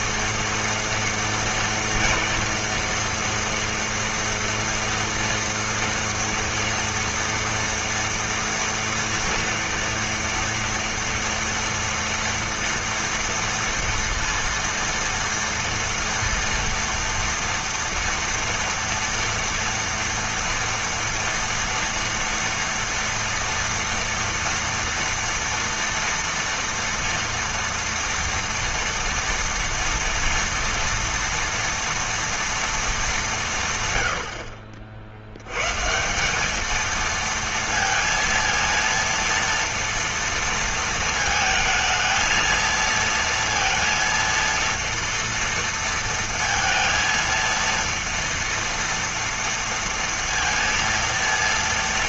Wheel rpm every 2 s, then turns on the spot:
230, 240, 230, 230, 230, 230, 230, 230, 230, 230, 230, 230, 230, 230, 230, 240, 200, 60, 230, 230, 220, 230, 230, 230, 230, 230.
none